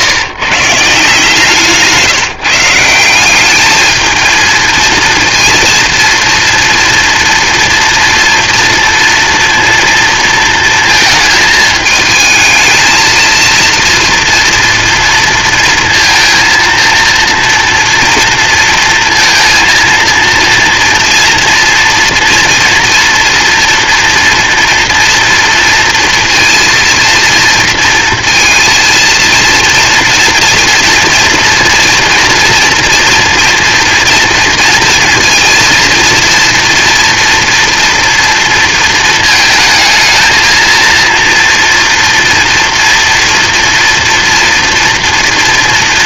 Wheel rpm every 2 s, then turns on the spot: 150, 160, 230, 230, 230, 220, 220, 230, 230, 230, 230, 240, 230, 230, 230, 230, 240, 230, 230, 230, 230, 230, 230.
none